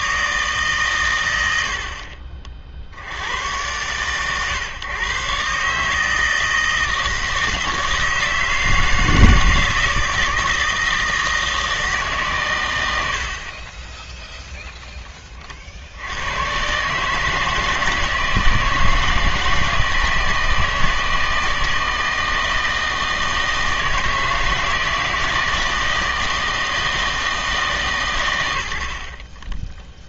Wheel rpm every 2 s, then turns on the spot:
130, 50, 130, 160, 160, 160, 100, 0, 130, 160, 160, 160, 160, 160, 80.
none